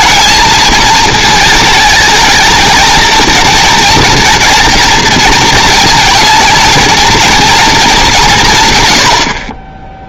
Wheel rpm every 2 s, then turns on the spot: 230, 230, 230, 230, 110.
none